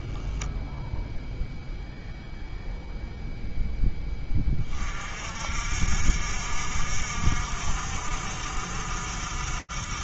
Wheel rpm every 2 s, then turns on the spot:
0, 10, 60, 60, 60.
none